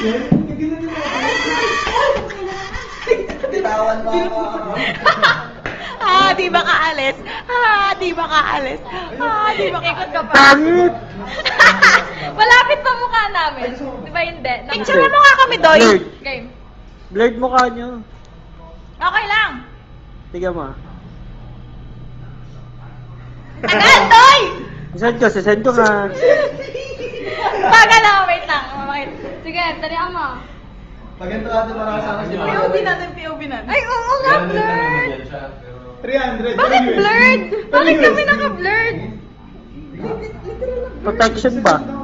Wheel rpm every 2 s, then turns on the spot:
80, 70, 20, 0, 0, 0, 0, 0, 0, 0, 0, 0, 0, 0, 0, 0, 0, 0, 0, 0, 0.
none